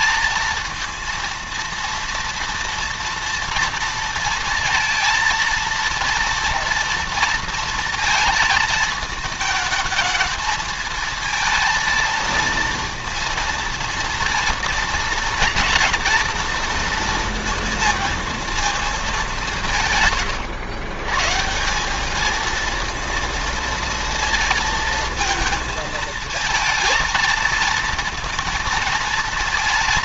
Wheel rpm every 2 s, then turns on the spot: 230, 230, 230, 230, 220, 220, 230, 230, 230, 220, 100, 210, 230, 230, 230.
none